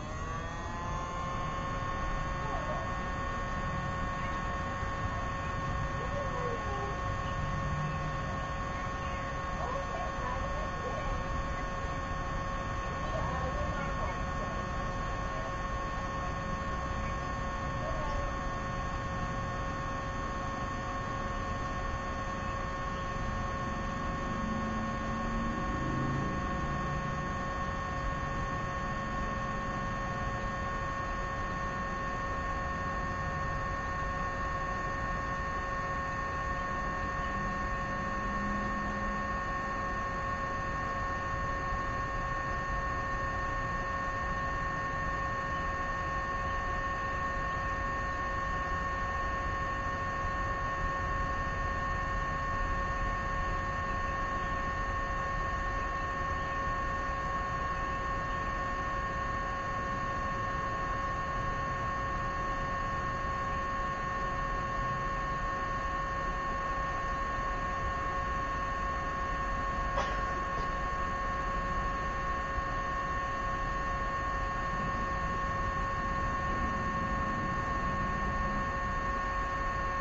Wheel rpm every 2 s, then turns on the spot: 0, 0, 0, 0, 0, 0, 0, 0, 0, 0, 0, 0, 0, 0, 0, 0, 0, 0, 0, 0, 0, 0, 0, 0, 0, 0, 0, 0, 0, 0, 0, 0, 0, 0, 0, 0, 0, 0, 0, 0.
none